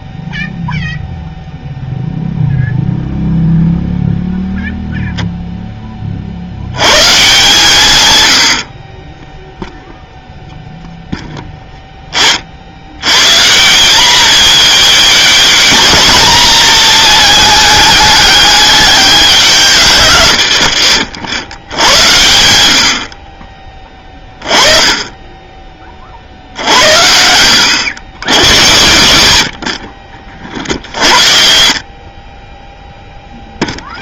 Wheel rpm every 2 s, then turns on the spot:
0, 0, 0, 130, 40, 0, 100, 220, 220, 200, 70, 70, 10, 70, 100, 60, 0.
20-22